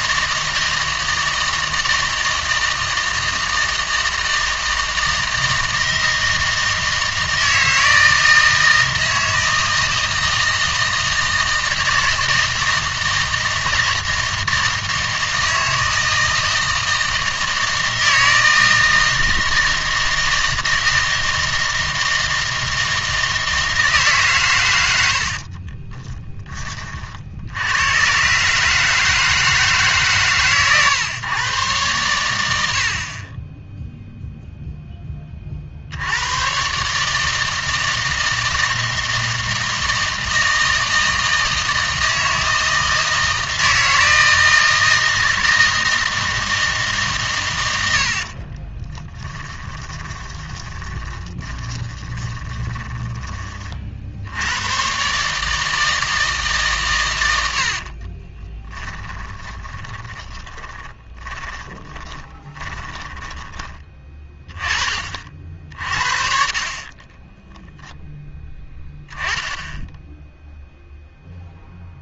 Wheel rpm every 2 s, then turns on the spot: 160, 160, 160, 160, 160, 160, 160, 160, 160, 160, 160, 160, 120, 20, 150, 130, 80, 0, 120, 160, 160, 160, 160, 160, 30, 20, 20, 100, 140, 20, 20, 30, 20, 40, 10, 0.
48-54 58-64